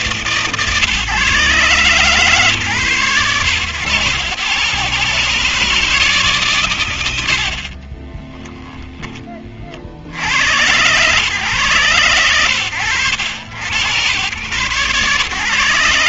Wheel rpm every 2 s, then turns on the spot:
140, 110, 140, 70, 20, 110, 80, 120.
none